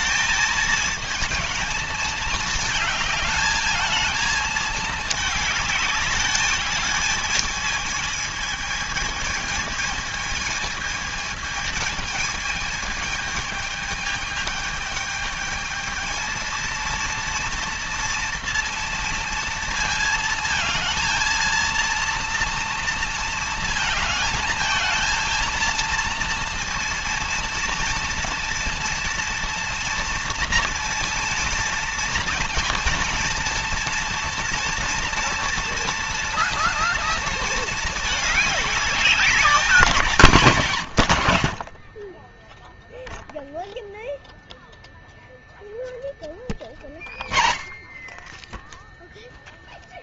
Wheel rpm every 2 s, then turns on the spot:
220, 220, 220, 210, 220, 220, 220, 210, 230, 230, 230, 230, 220, 230, 230, 230, 230, 230, 230, 210, 130, 0, 0, 40, 10.
none